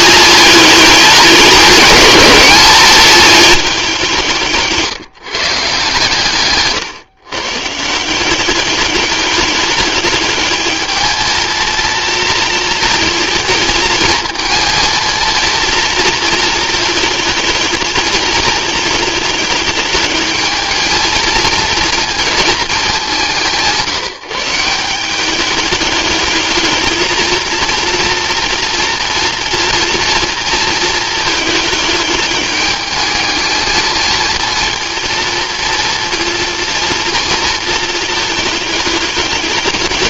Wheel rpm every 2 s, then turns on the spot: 210, 210, 160, 130, 200, 220, 220, 220, 220, 210, 220, 200, 180, 220, 230, 220, 210, 230, 230, 210.
none